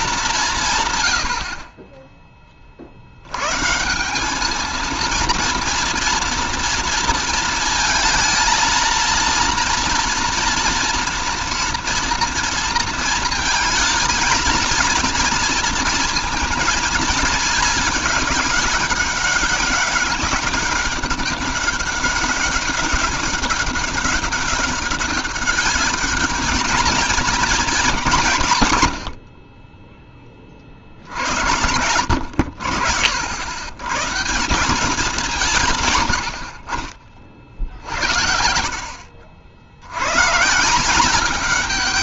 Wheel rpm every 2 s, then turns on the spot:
160, 40, 220, 230, 230, 230, 230, 230, 230, 200, 200, 190, 200, 210, 110, 40, 70, 170, 60, 50, 160.
none